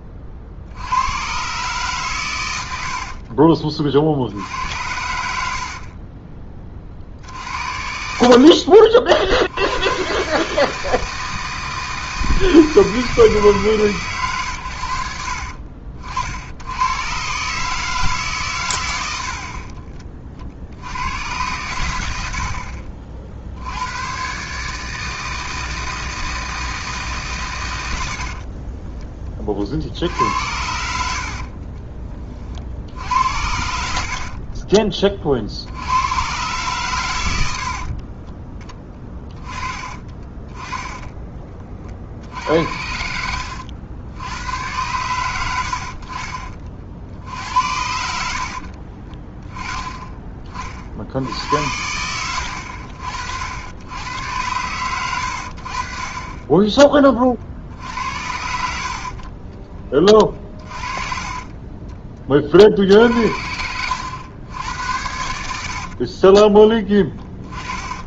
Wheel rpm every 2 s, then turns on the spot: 50, 90, 80, 30, 50, 150, 160, 110, 90, 120, 60, 60, 140, 160, 40, 80, 40, 10, 120, 20, 10, 70, 100, 50, 70, 30, 70, 100, 20, 60, 30, 50, 80, 10.
2-4 28-30 38-40 42-44 48-50 60-62 66-68